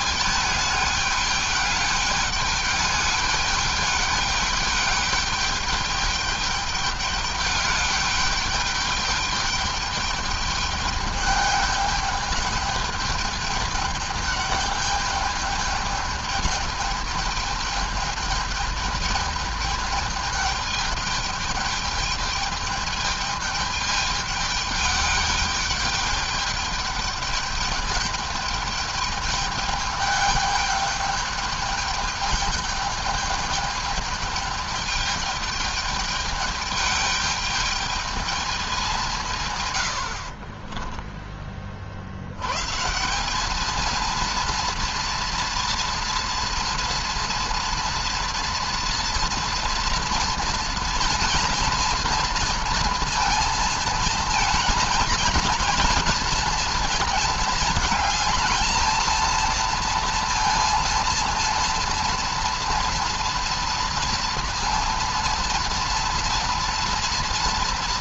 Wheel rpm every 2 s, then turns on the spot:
210, 210, 210, 210, 210, 210, 210, 210, 210, 210, 210, 210, 210, 210, 210, 210, 210, 210, 210, 210, 40, 100, 230, 230, 230, 230, 230, 230, 230, 220, 230, 230, 230, 230.
40-42